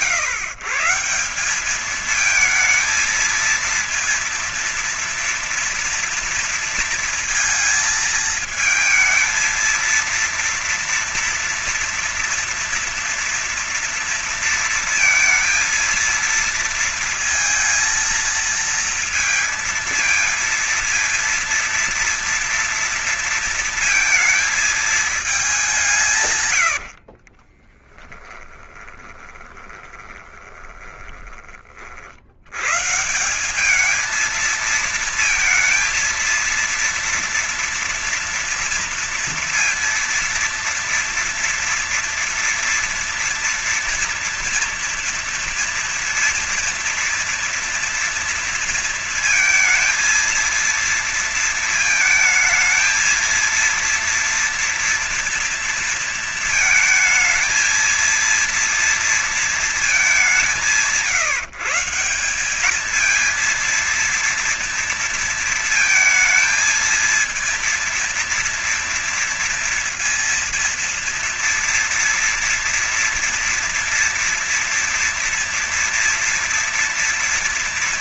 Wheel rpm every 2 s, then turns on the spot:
170, 220, 230, 230, 230, 230, 240, 230, 230, 230, 230, 230, 220, 120, 20, 20, 110, 220, 230, 230, 230, 230, 230, 230, 230, 230, 230, 230, 230, 230, 170, 190, 230, 220, 230, 230, 230, 240, 230.
26-32